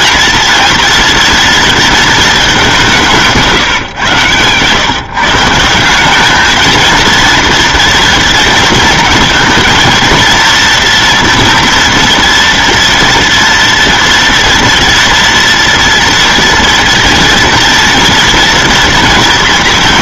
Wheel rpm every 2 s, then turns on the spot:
230, 180, 140, 220, 230, 230, 230, 230, 230, 230.
none